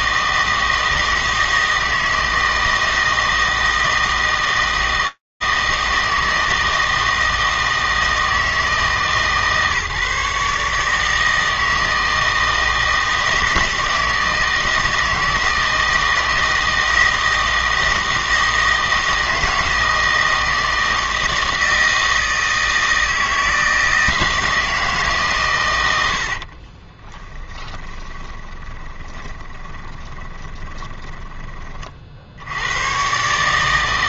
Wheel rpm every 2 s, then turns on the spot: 160, 160, 160, 160, 150, 150, 160, 160, 160, 160, 160, 160, 160, 30, 20, 20, 110.
26-32